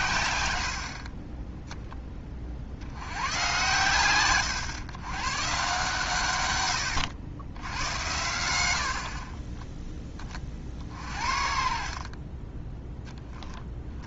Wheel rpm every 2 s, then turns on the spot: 70, 50, 120, 100, 70, 40, 10.
12-14